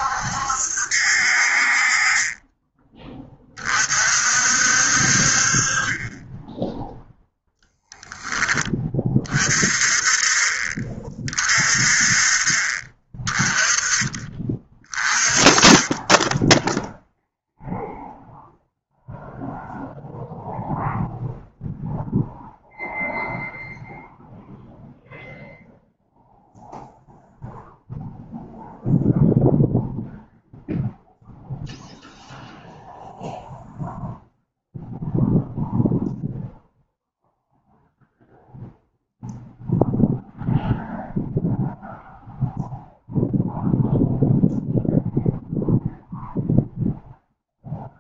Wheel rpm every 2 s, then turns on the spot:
60, 20, 50, 0, 20, 30, 20, 30, 0, 0, 0, 0, 0, 0, 0, 0, 0, 0, 0, 0, 0, 0, 0, 0.
none